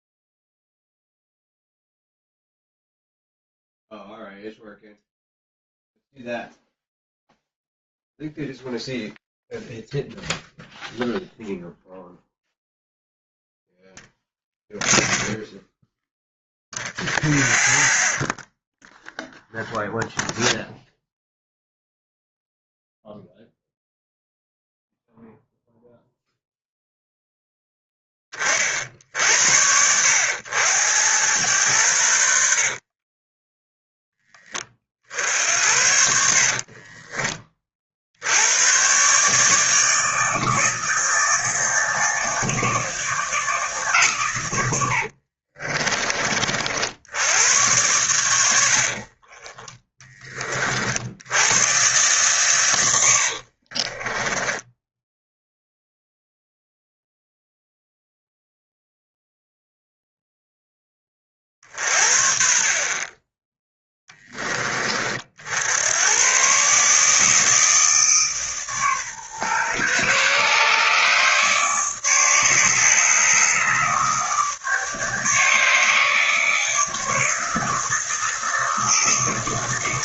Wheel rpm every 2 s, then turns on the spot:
0, 0, 0, 0, 0, 0, 0, 0, 0, 0, 0, 0, 0, 0, 50, 90, 50, 30, 40, 110, 160, 160, 80, 60, 80, 50, 100, 10, 0, 0, 10, 50, 30, 140, 140, 140, 150, 150, 150, 160.
32-34 36-38 44-46 48-50 54-56